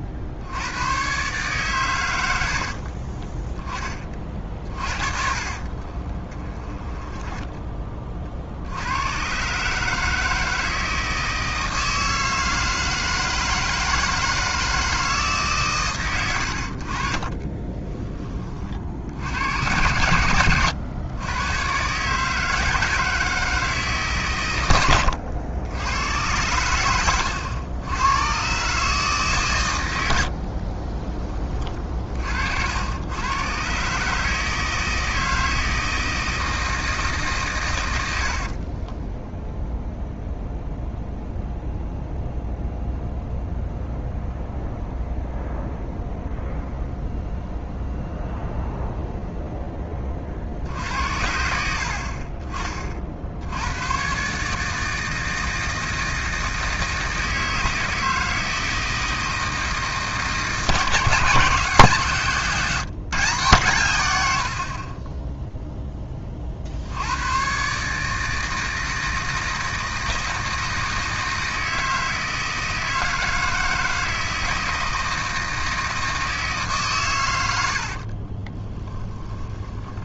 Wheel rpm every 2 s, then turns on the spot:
80, 70, 40, 20, 70, 160, 160, 160, 70, 40, 100, 160, 110, 110, 130, 50, 60, 150, 160, 40, 0, 0, 0, 0, 0, 60, 40, 150, 160, 160, 160, 160, 80, 60, 160, 160, 160, 160, 150, 30.
2-8 30-32 38-40 78-80